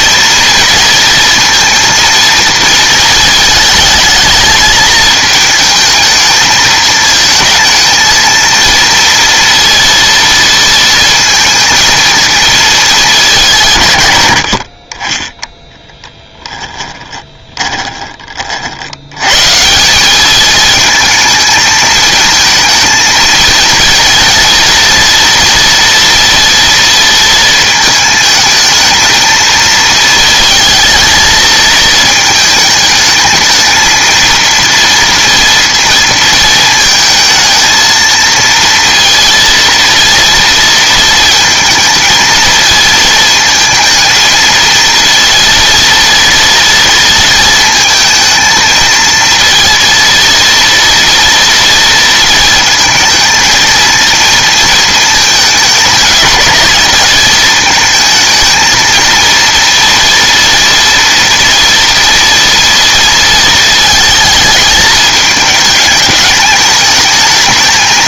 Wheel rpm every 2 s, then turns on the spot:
230, 230, 220, 220, 230, 230, 220, 50, 10, 50, 220, 220, 230, 230, 220, 220, 220, 230, 220, 230, 230, 220, 230, 230, 230, 230, 220, 230, 220, 230, 230, 230, 220, 220.
16-18